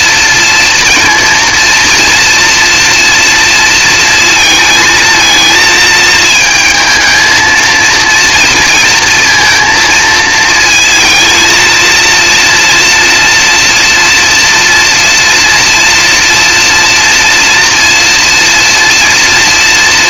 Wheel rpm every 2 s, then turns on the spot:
230, 240, 230, 220, 230, 230, 230, 230, 230, 230.
none